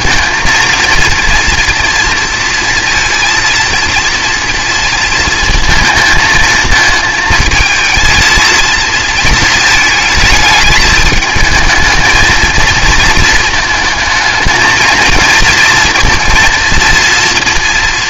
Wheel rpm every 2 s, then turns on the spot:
230, 230, 230, 220, 230, 220, 230, 220, 230.
none